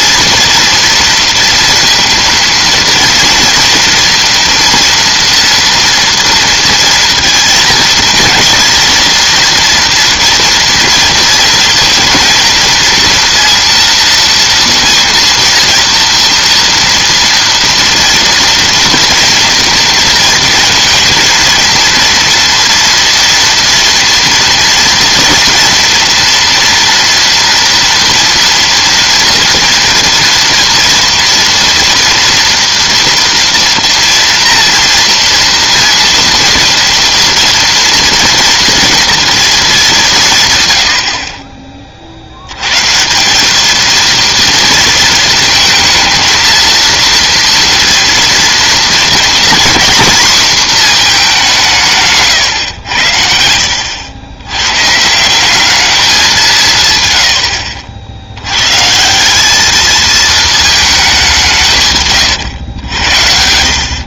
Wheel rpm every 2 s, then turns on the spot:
230, 230, 230, 230, 230, 230, 230, 230, 230, 230, 230, 230, 230, 230, 230, 230, 230, 240, 230, 230, 100, 120, 230, 230, 230, 230, 100, 120, 150, 130, 220, 100.
none